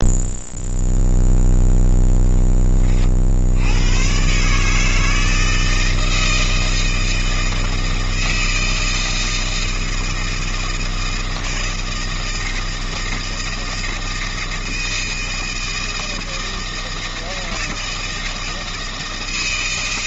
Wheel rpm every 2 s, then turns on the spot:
0, 10, 140, 160, 160, 160, 160, 160, 160, 160.
none